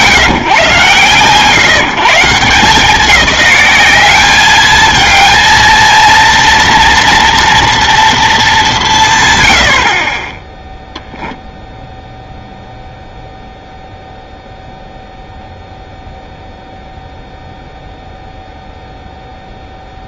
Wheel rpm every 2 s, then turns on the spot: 150, 170, 210, 230, 200, 0, 0, 0, 0, 0.
none